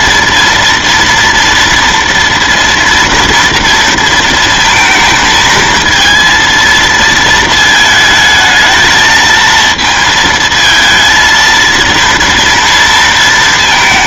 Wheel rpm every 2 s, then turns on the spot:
230, 230, 230, 230, 220, 220, 230.
none